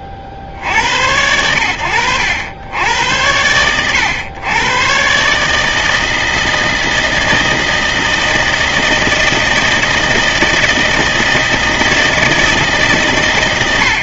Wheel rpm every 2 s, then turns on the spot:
30, 80, 110, 160, 160, 160, 150.
none